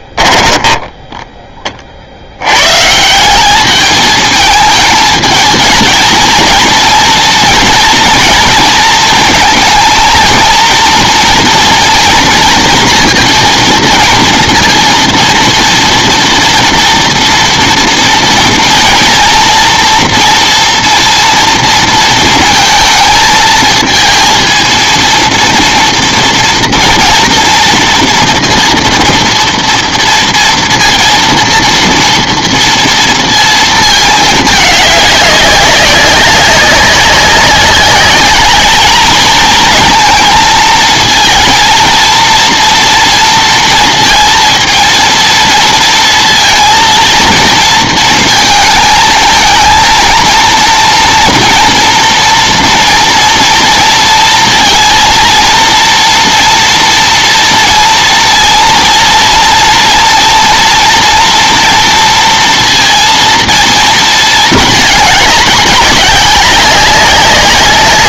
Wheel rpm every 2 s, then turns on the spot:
10, 110, 220, 230, 230, 230, 230, 230, 230, 230, 240, 220, 230, 230, 230, 230, 230, 210, 200, 210, 230, 230, 230, 230, 220, 230, 230, 230, 230, 230, 230, 230, 220, 200.
0-2